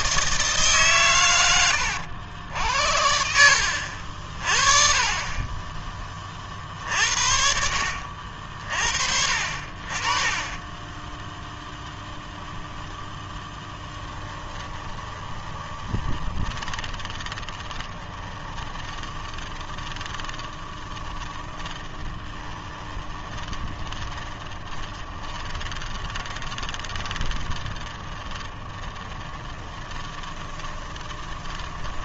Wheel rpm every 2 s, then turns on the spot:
140, 80, 40, 60, 50, 10, 20, 20, 20, 20, 20, 20, 20, 20, 30, 20.
10-32